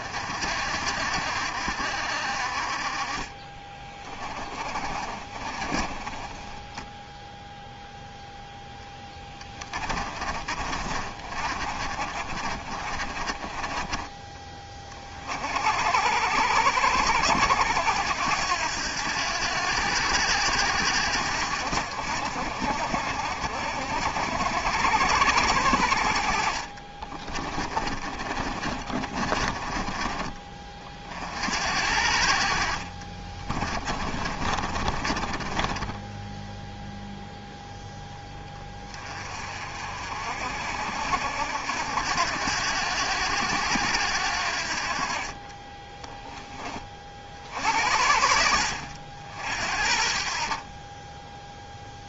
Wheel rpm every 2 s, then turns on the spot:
40, 40, 30, 10, 0, 40, 40, 20, 80, 80, 80, 60, 70, 50, 40, 30, 50, 40, 0, 20, 60, 80, 60, 20, 60, 40.
4-8 10-14 26-30 34-36